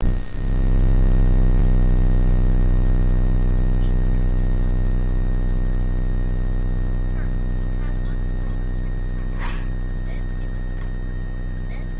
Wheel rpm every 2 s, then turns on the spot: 0, 0, 0, 0, 0, 0.
none